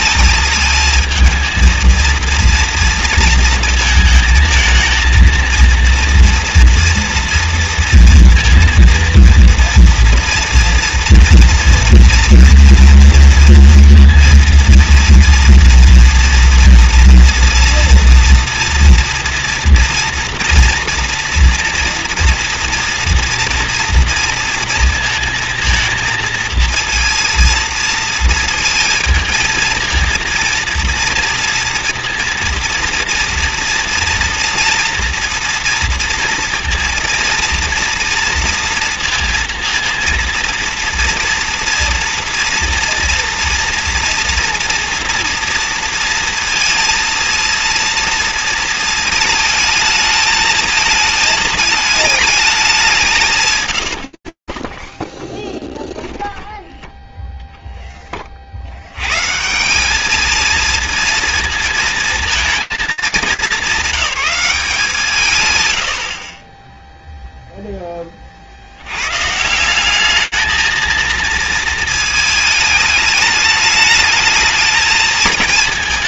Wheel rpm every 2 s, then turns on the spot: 220, 230, 220, 230, 230, 230, 230, 230, 230, 240, 230, 230, 230, 230, 230, 230, 240, 240, 230, 230, 230, 230, 240, 230, 230, 220, 170, 10, 10, 80, 220, 220, 180, 10, 110, 230, 210, 190.
none